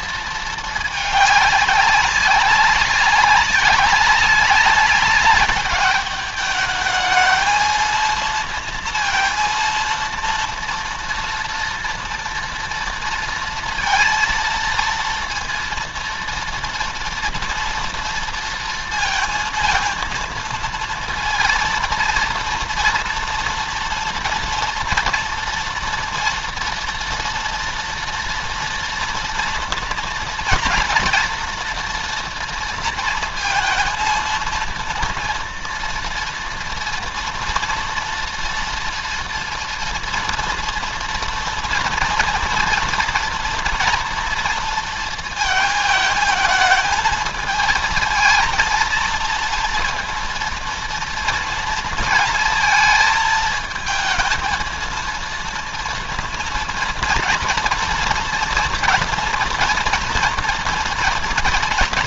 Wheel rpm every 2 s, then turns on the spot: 220, 200, 190, 210, 230, 230, 230, 230, 230, 230, 230, 230, 230, 230, 230, 230, 230, 230, 240, 230, 230, 230, 230, 220, 220, 230, 220, 220, 230, 230, 230.
none